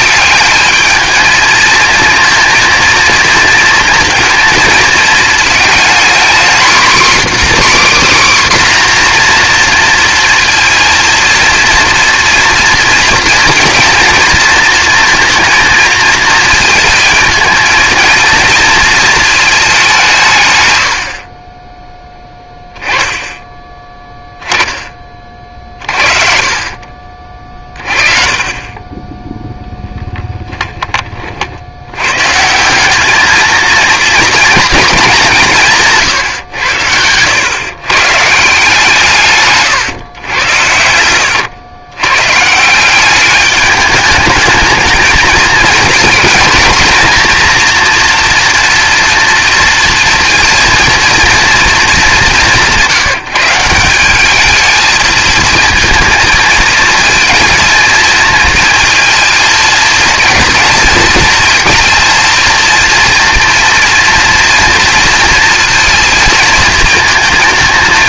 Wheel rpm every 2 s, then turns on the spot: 220, 230, 220, 260, 260, 230, 240, 230, 220, 230, 90, 10, 20, 40, 20, 20, 190, 210, 100, 160, 90, 180, 220, 230, 230, 230, 180, 220, 230, 230, 220, 230, 230, 220.
36-38 40-42